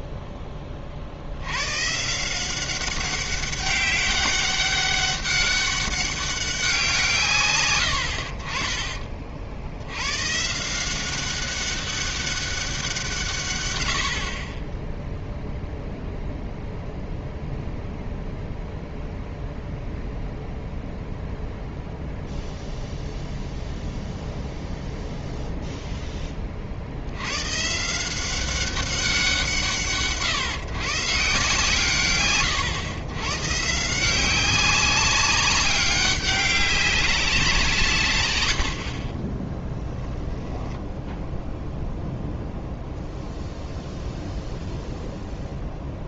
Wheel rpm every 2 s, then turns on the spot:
30, 190, 200, 180, 30, 170, 190, 30, 0, 0, 0, 0, 0, 60, 190, 130, 120, 190, 190, 70, 0, 0, 0.
none